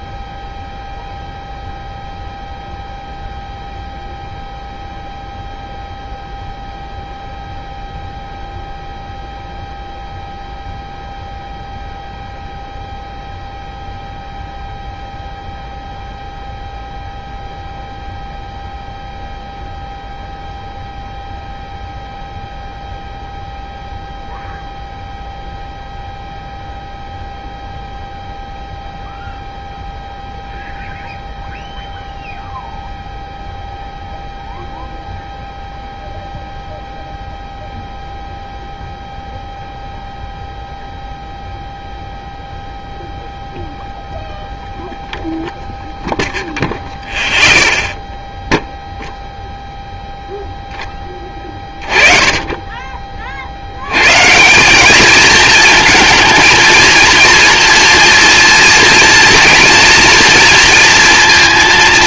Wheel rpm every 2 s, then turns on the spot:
0, 0, 0, 0, 0, 0, 0, 0, 0, 0, 0, 0, 0, 0, 0, 0, 0, 0, 0, 0, 0, 0, 0, 0, 0, 0, 20, 170, 230, 230, 230.
none